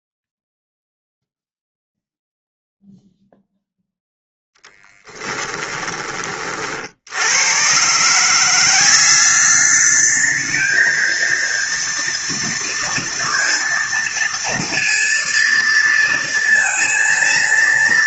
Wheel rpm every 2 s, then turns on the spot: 0, 0, 0, 40, 180, 220, 230, 230, 230.
none